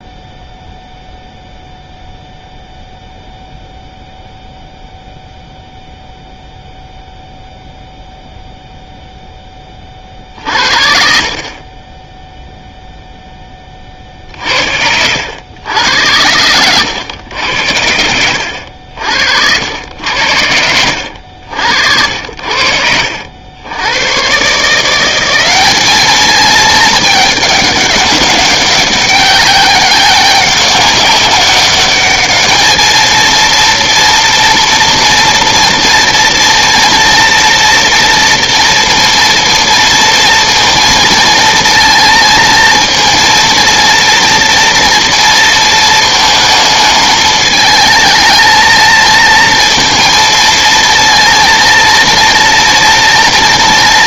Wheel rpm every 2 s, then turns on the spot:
0, 0, 0, 0, 0, 50, 0, 70, 100, 70, 90, 70, 150, 210, 200, 190, 210, 240, 230, 230, 230, 230, 230, 220, 220, 230, 230.
none